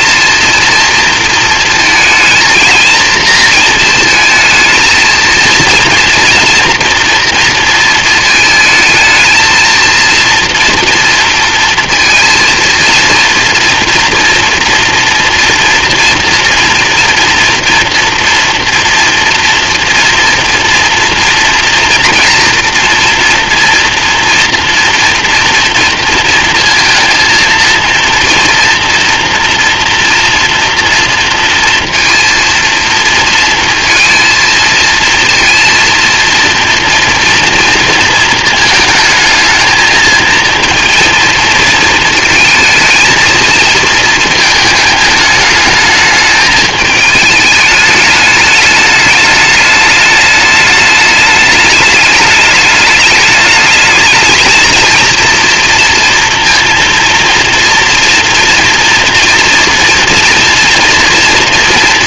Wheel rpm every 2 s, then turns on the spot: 230, 230, 220, 230, 220, 230, 230, 240, 240, 230, 240, 230, 230, 230, 230, 240, 230, 230, 230, 220, 230, 220, 220, 210, 210, 210, 210, 220, 230, 240, 230.
none